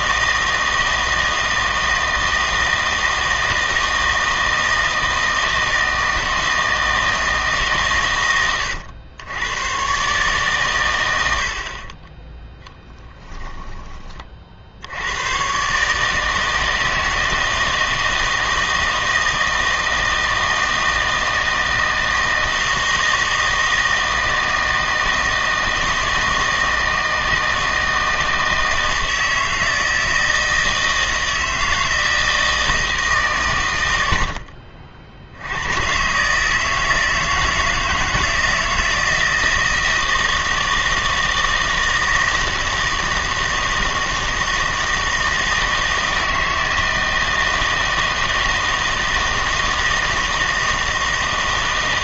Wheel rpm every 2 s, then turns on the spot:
160, 160, 160, 160, 100, 100, 10, 70, 160, 160, 160, 160, 160, 160, 160, 160, 160, 60, 160, 160, 160, 160, 160, 160, 160, 160.
12-14